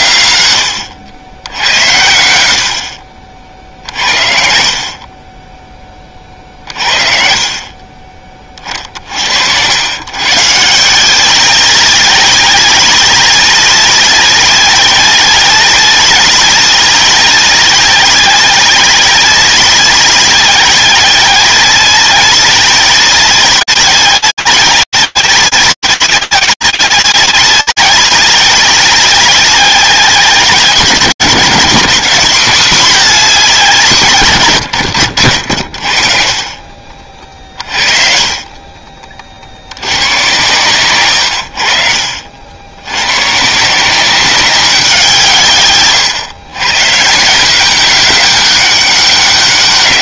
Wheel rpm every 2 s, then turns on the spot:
100, 50, 50, 50, 50, 160, 190, 190, 190, 190, 190, 190, 190, 190, 190, 180, 200, 120, 40, 30, 130, 90, 190, 140, 200.
38-40